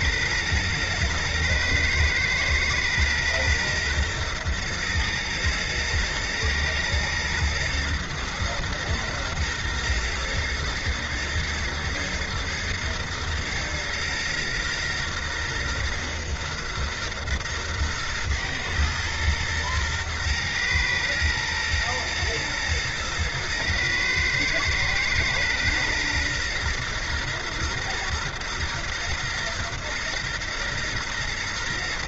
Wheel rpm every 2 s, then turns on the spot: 110, 120, 120, 110, 120, 120, 120, 120, 120, 120, 120, 120, 110, 120, 120, 120.
none